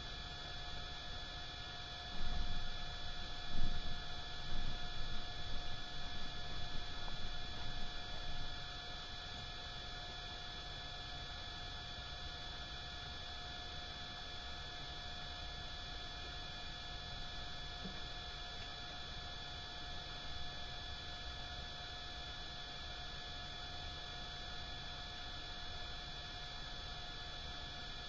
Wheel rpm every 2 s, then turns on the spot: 0, 0, 0, 0, 0, 0, 0, 0, 0, 0, 0, 0, 0, 0.
none